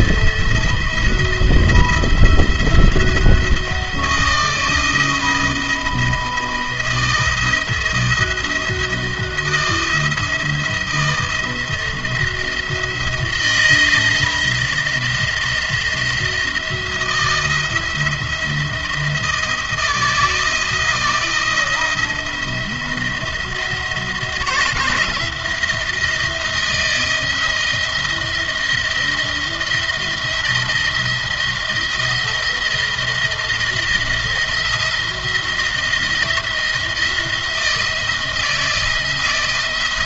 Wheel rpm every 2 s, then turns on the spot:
170, 160, 170, 170, 170, 170, 170, 170, 170, 170, 160, 170, 170, 170, 170, 170, 170, 170, 170, 160.
none